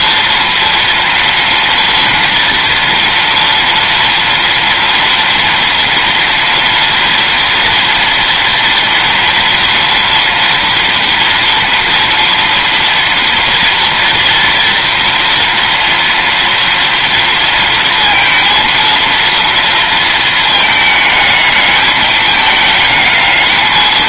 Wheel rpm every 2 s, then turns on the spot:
230, 230, 230, 230, 240, 230, 240, 230, 230, 230, 220, 220.
none